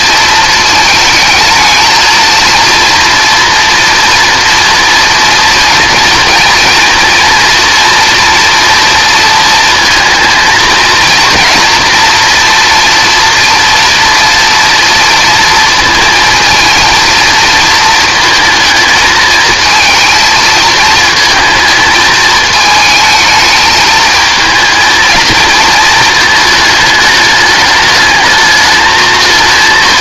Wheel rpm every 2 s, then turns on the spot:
220, 230, 230, 230, 230, 230, 230, 230, 230, 220, 220, 220, 220, 220, 220.
none